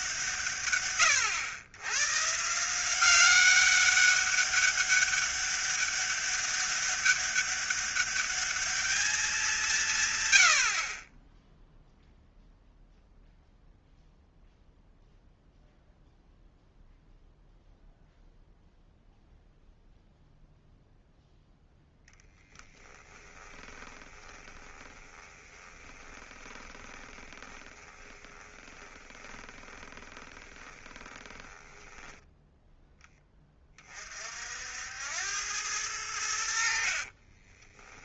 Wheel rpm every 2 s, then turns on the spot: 130, 180, 200, 200, 220, 20, 0, 0, 0, 0, 0, 10, 20, 20, 20, 20, 10, 80, 60.
22-32